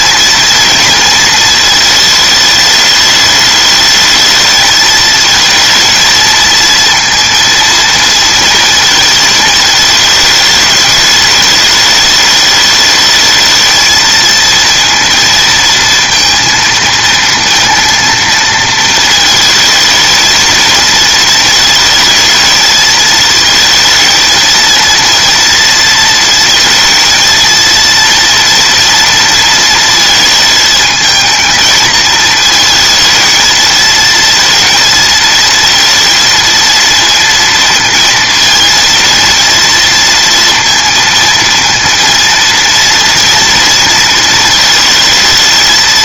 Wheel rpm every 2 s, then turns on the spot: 230, 230, 210, 230, 230, 220, 210, 220, 230, 230, 220, 230, 220, 230, 230, 230, 220, 220, 230, 230, 230, 230, 230.
none